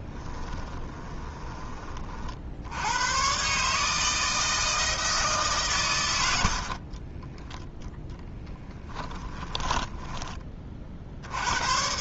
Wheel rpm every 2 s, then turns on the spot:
10, 80, 160, 50, 10, 40.
0-2 6-10